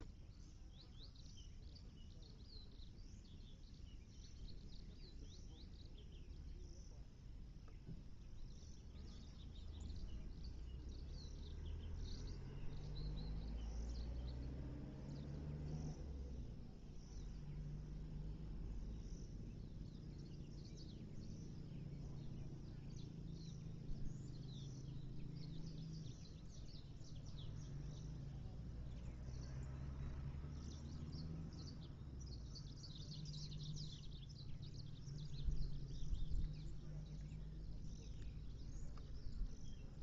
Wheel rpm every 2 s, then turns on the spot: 0, 0, 0, 0, 0, 0, 0, 0, 0, 0, 0, 0, 0, 0, 0, 0, 0, 0, 0, 0.
none